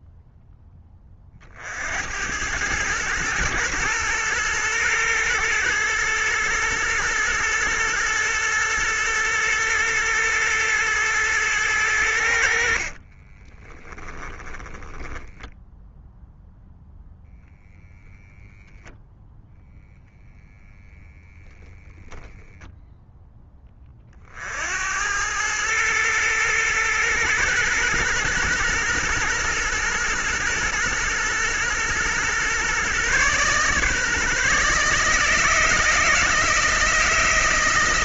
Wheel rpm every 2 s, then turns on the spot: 10, 110, 110, 120, 110, 110, 60, 10, 0, 0, 0, 0, 80, 110, 110, 120, 130, 150, 160.
12-16